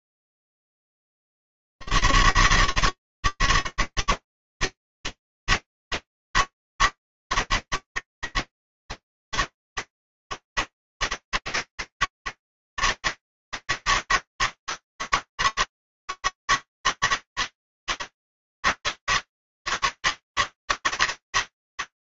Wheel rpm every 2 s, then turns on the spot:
160, 150, 160, 160, 160, 160, 160, 160, 160, 150, 160.
none